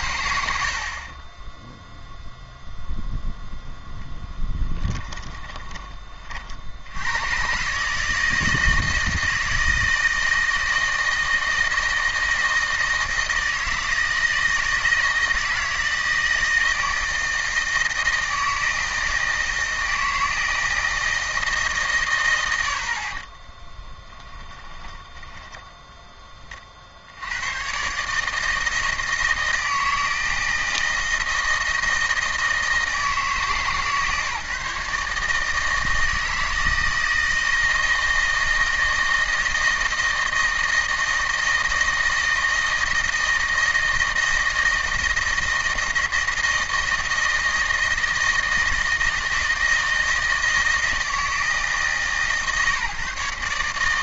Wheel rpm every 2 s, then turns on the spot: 70, 0, 20, 70, 160, 160, 160, 160, 160, 160, 160, 70, 10, 50, 160, 170, 160, 150, 160, 160, 160, 160, 160, 160, 160, 160, 150.
4-6 24-26